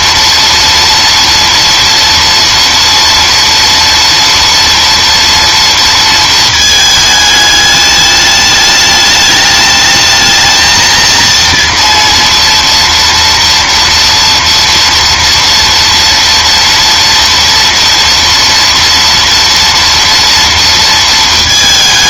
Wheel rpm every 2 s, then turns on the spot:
230, 240, 230, 220, 210, 230, 230, 230, 230, 230, 230.
none